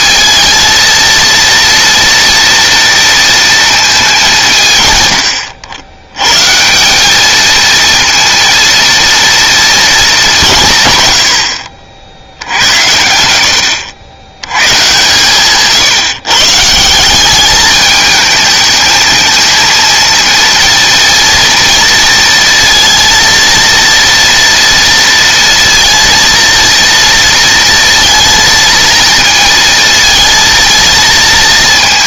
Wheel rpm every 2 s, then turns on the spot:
220, 230, 180, 120, 230, 180, 70, 110, 140, 220, 230, 230, 230, 230, 230, 220.
none